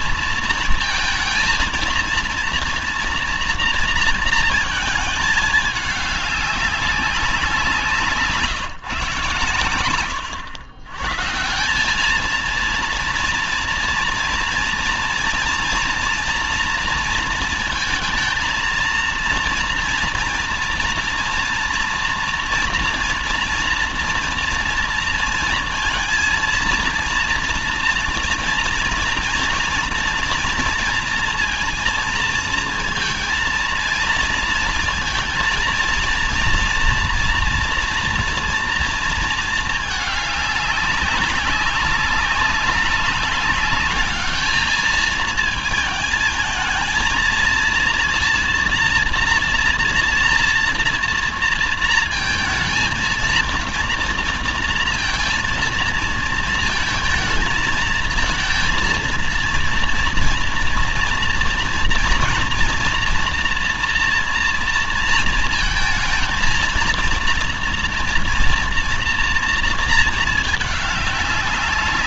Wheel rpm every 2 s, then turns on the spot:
230, 230, 230, 200, 130, 110, 230, 230, 230, 230, 230, 230, 230, 230, 230, 230, 230, 230, 240, 230, 200, 190, 220, 220, 240, 230, 230, 230, 220, 230, 230, 230, 230, 230, 230, 210.
none